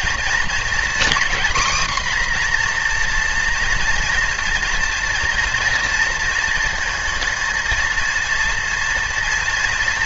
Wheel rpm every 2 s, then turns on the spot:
240, 250, 230, 230, 230.
none